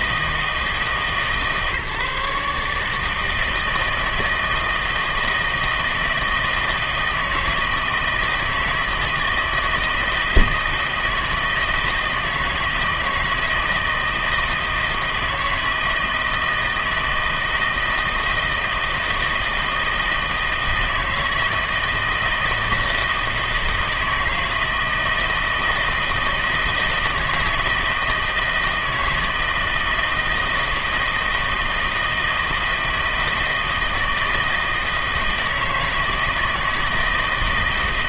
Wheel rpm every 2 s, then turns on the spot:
150, 150, 160, 160, 160, 160, 160, 160, 160, 160, 160, 160, 160, 160, 160, 160, 160, 160, 160.
none